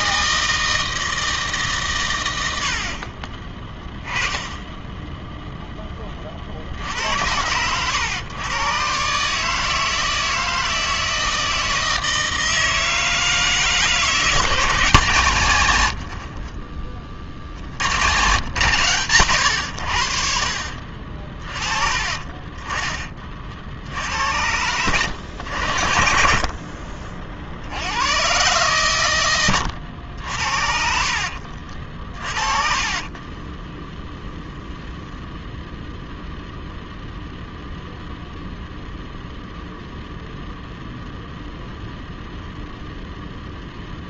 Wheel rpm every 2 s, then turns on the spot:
160, 70, 10, 50, 120, 160, 160, 160, 40, 130, 50, 30, 90, 50, 130, 70, 30, 0, 0, 0, 0, 0.
16-18 20-22 26-28 32-34